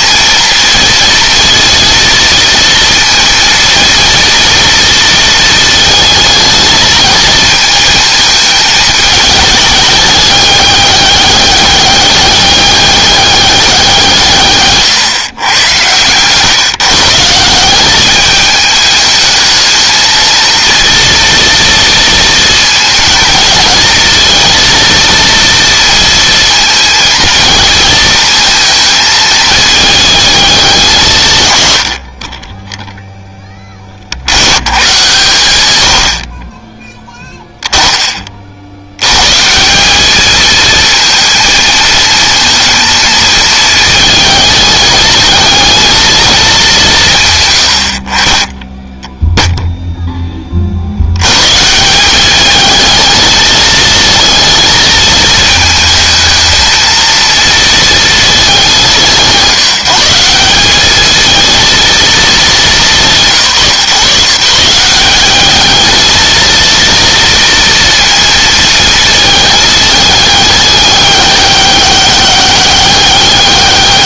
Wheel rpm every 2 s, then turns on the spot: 230, 230, 230, 220, 220, 200, 200, 140, 140, 210, 230, 230, 230, 230, 220, 190, 10, 110, 10, 80, 220, 230, 220, 170, 0, 50, 210, 220, 220, 200, 200, 200, 170, 230, 230, 200, 200.
none